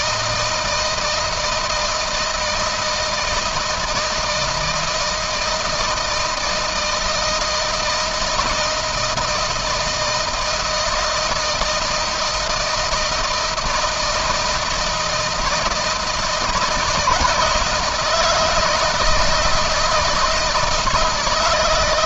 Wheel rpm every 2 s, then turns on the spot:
160, 160, 160, 160, 160, 160, 160, 160, 160, 160, 170.
none